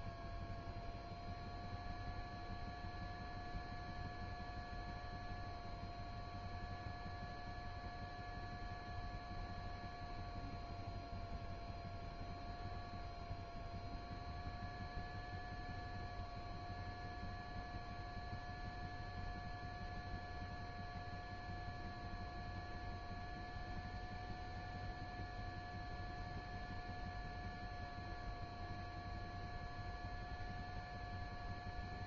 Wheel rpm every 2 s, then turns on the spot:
0, 0, 0, 0, 0, 0, 0, 0, 0, 0, 0, 0, 0, 0, 0, 0.
none